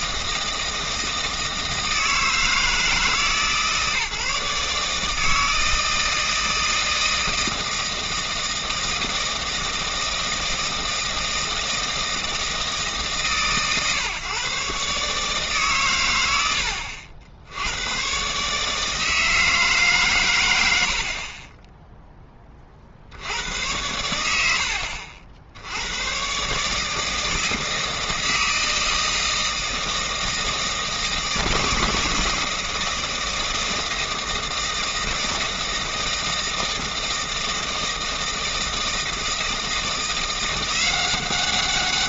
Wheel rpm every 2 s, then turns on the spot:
160, 160, 160, 160, 160, 160, 150, 140, 80, 150, 90, 40, 80, 150, 160, 160, 160, 160, 160, 160, 180.
none